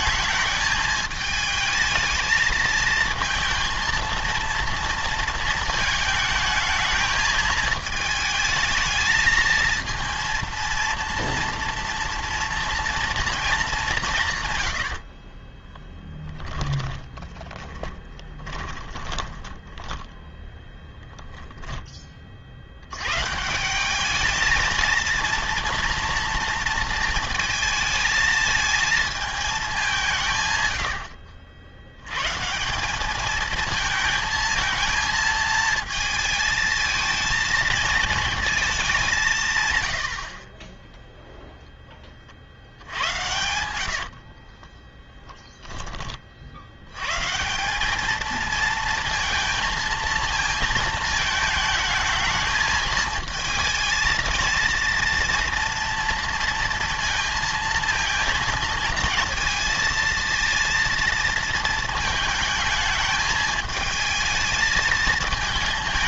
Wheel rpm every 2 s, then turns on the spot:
220, 220, 230, 220, 220, 230, 230, 110, 10, 20, 10, 60, 220, 230, 220, 120, 160, 230, 220, 220, 30, 70, 40, 70, 230, 230, 220, 230, 230, 230, 230, 220, 220.
16-20 44-46